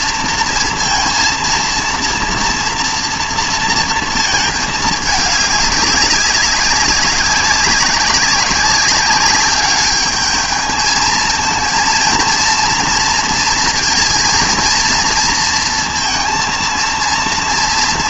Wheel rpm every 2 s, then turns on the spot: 230, 230, 220, 200, 190, 220, 230, 230, 230.
none